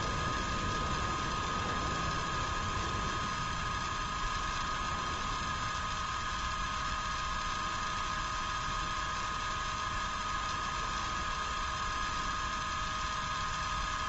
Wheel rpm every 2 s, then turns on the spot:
0, 0, 0, 0, 0, 0, 0.
none